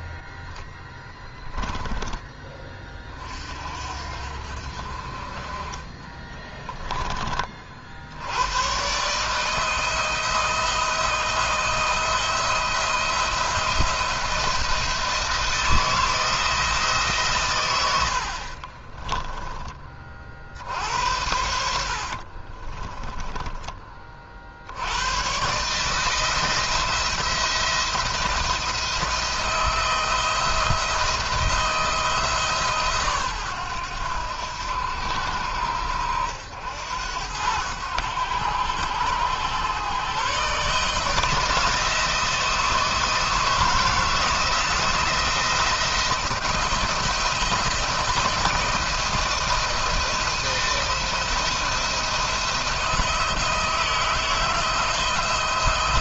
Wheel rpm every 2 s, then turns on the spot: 10, 30, 40, 20, 130, 160, 170, 170, 150, 20, 80, 20, 90, 170, 160, 170, 140, 80, 80, 100, 150, 160, 160, 160, 170, 170, 170, 160.
18-24